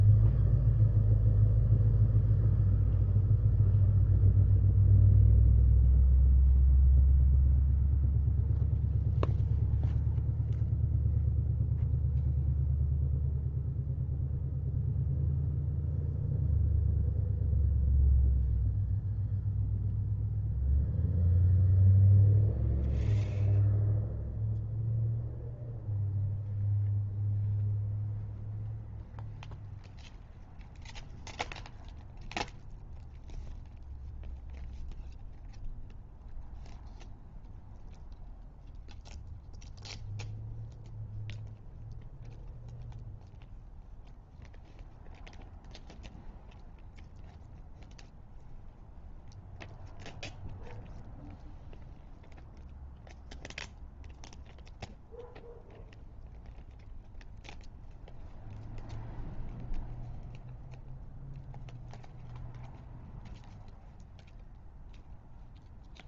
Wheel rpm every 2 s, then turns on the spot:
0, 0, 0, 0, 0, 0, 0, 0, 0, 0, 0, 0, 0, 0, 0, 0, 0, 0, 0, 0, 0, 0, 0, 0, 0, 0, 0, 0, 0, 0, 0, 0, 0.
none